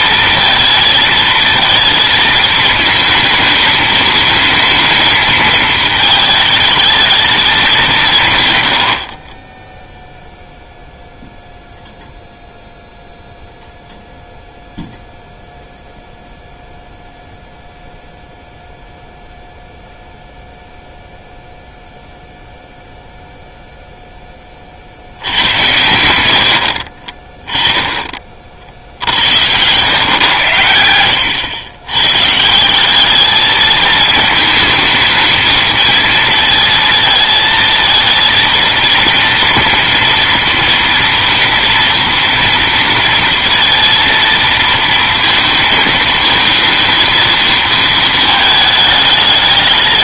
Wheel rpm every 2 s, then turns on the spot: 230, 220, 220, 220, 100, 0, 0, 0, 0, 0, 0, 0, 30, 60, 50, 90, 170, 220, 220, 230, 230, 230, 230, 220, 220.
none